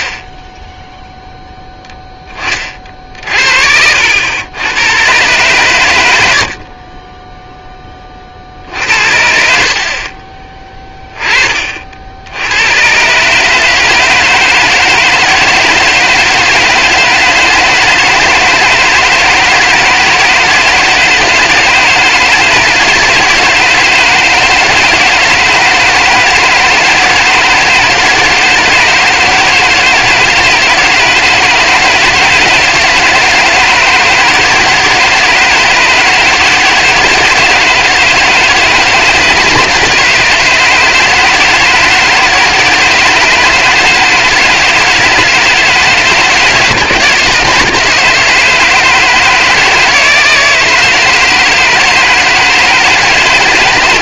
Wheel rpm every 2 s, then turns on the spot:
10, 30, 100, 50, 50, 10, 100, 160, 160, 160, 160, 160, 160, 160, 160, 160, 160, 160, 160, 160, 160, 160, 160, 160, 160, 160, 160.
0-2